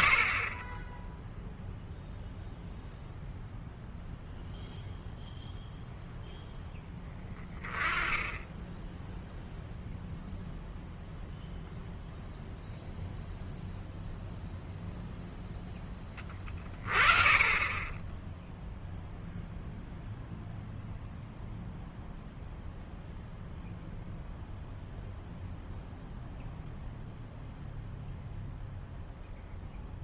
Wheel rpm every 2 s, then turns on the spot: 10, 0, 0, 0, 10, 0, 0, 0, 30, 0, 0, 0, 0, 0, 0.
none